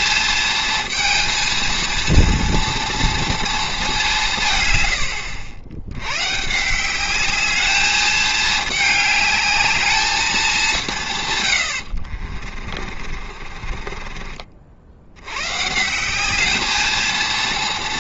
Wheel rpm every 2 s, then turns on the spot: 230, 230, 120, 160, 210, 180, 40, 60, 220.
12-14